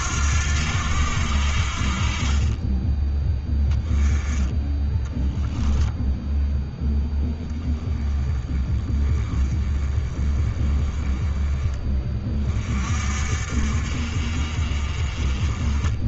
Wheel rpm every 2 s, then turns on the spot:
80, 20, 10, 0, 20, 20, 40, 40.
none